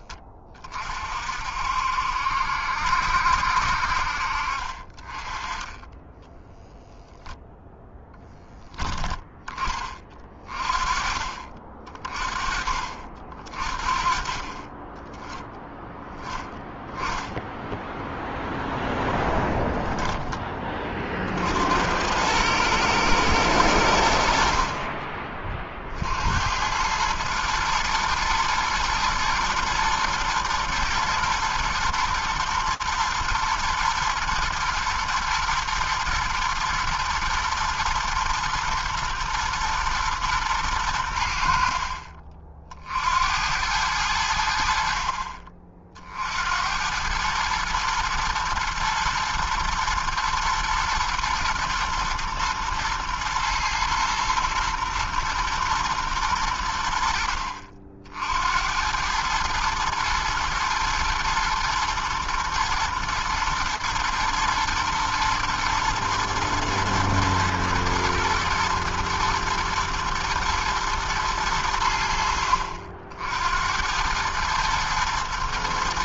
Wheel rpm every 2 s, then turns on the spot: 20, 70, 50, 10, 10, 30, 30, 30, 10, 0, 20, 100, 60, 70, 120, 110, 110, 110, 110, 110, 110, 40, 80, 60, 120, 110, 120, 120, 110, 70, 110, 110, 120, 110, 120, 120, 70, 110.
6-8